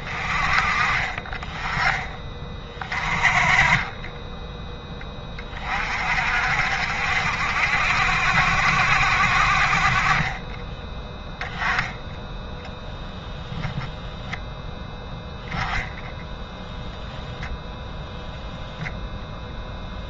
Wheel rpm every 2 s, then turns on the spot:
30, 30, 10, 60, 70, 20, 0, 0, 0, 0.
none